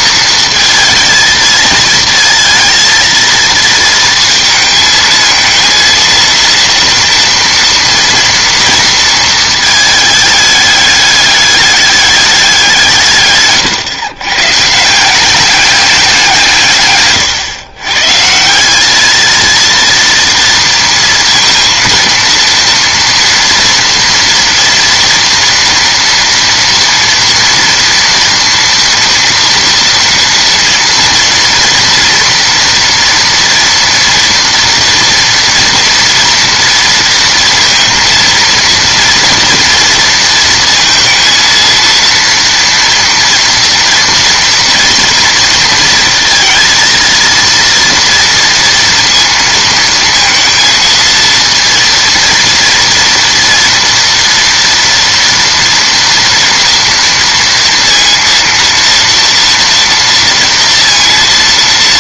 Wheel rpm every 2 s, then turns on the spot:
220, 230, 220, 230, 230, 210, 170, 150, 140, 190, 230, 230, 240, 230, 230, 230, 230, 230, 230, 230, 230, 240, 230, 230, 230, 230, 230, 230, 230, 230, 240.
none